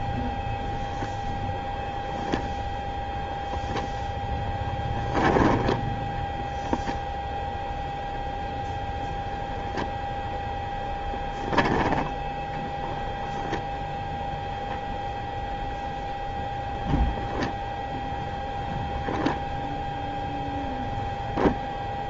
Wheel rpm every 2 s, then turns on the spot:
0, 0, 10, 0, 0, 0, 10, 0, 0, 0, 0.
none